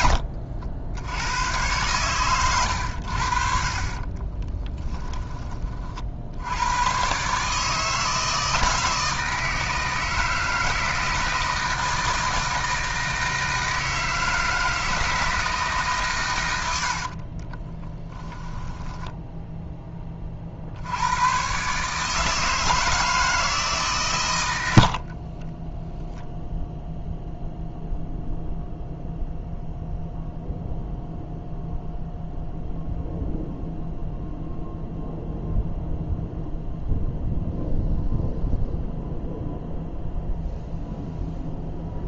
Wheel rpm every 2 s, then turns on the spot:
80, 90, 10, 110, 160, 160, 160, 160, 80, 10, 70, 160, 80, 0, 0, 0, 0, 0, 0, 0, 0.
16-20